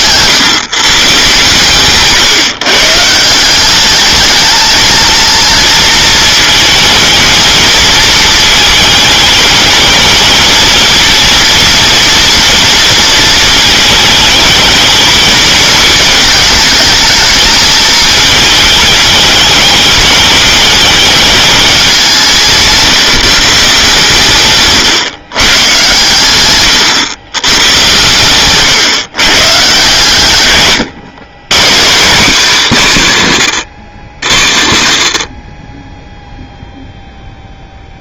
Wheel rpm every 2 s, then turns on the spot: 140, 150, 220, 220, 220, 220, 230, 220, 220, 210, 220, 150, 140, 110, 130, 110, 210, 60, 0.
24-26